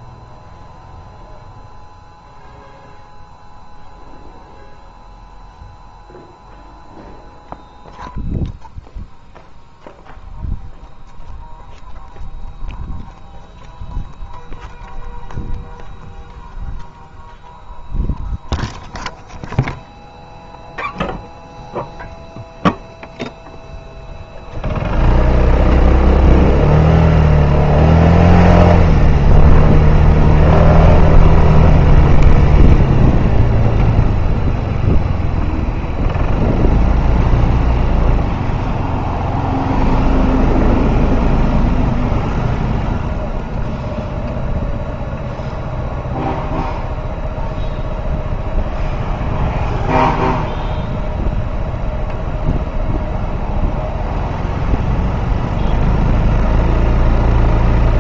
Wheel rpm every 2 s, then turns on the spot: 0, 0, 0, 0, 0, 0, 0, 0, 0, 0, 0, 0, 0, 0, 0, 0, 0, 0, 0, 0, 0, 0, 0, 0, 0, 0, 0, 0, 0.
none